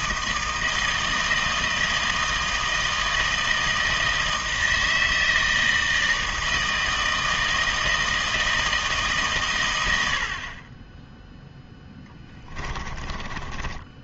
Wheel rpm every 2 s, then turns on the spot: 160, 160, 160, 160, 160, 30, 20.
12-14